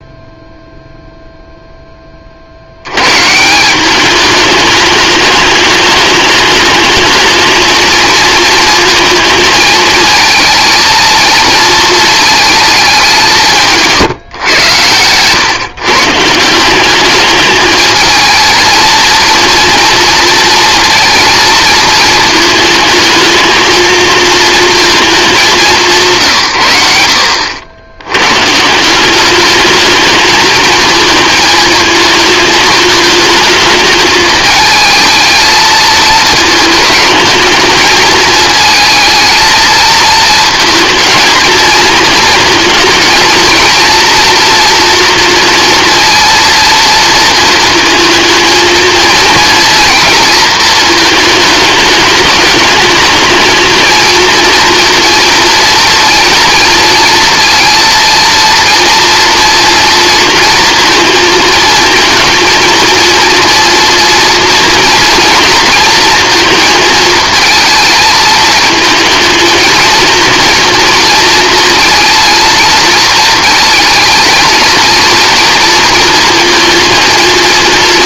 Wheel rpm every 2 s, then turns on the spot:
0, 70, 210, 210, 230, 220, 220, 110, 180, 220, 230, 220, 230, 120, 160, 220, 220, 220, 220, 220, 220, 220, 230, 230, 220, 220, 210, 230, 230, 230, 230, 230, 230, 220, 220, 230, 230, 230, 230.
none